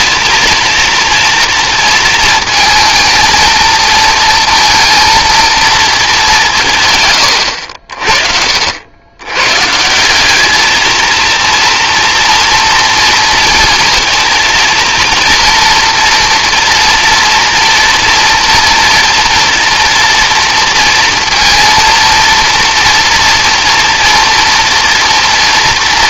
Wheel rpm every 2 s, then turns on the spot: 230, 220, 220, 140, 90, 220, 230, 230, 240, 230, 230, 230, 240.
none